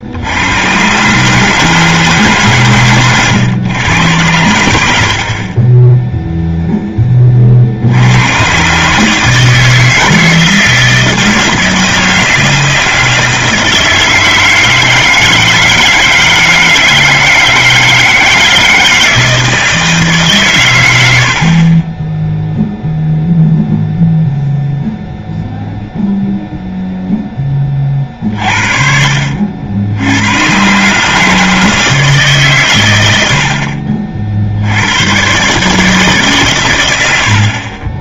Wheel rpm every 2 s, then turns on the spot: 120, 120, 90, 0, 130, 160, 160, 160, 160, 160, 110, 0, 0, 0, 50, 120, 130, 80, 110.
none